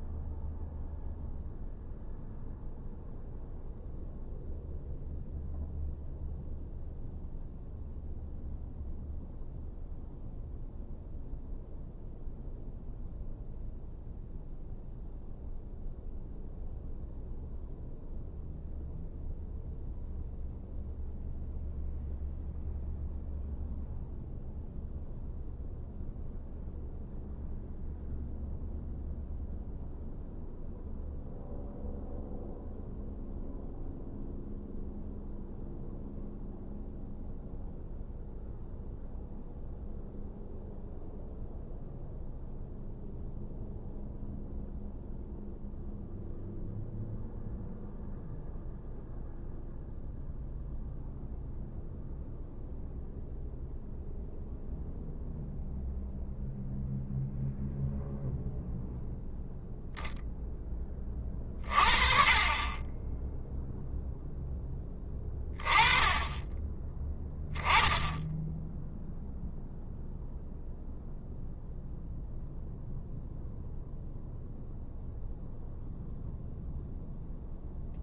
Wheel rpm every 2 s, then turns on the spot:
0, 0, 0, 0, 0, 0, 0, 0, 0, 0, 0, 0, 0, 0, 0, 0, 0, 0, 0, 0, 0, 0, 0, 0, 0, 0, 0, 0, 0, 0, 20, 20, 10, 20, 0, 0, 0, 0, 0.
none